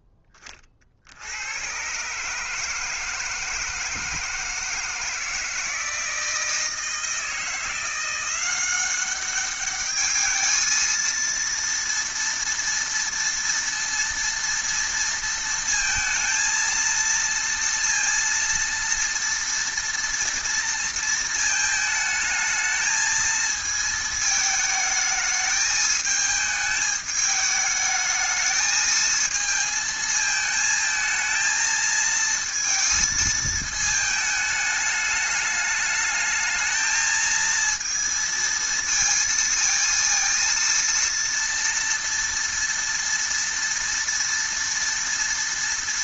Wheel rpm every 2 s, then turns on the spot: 20, 150, 160, 160, 180, 220, 230, 230, 220, 230, 230, 220, 220, 220, 220, 220, 230, 210, 220, 230, 230, 230, 230.
none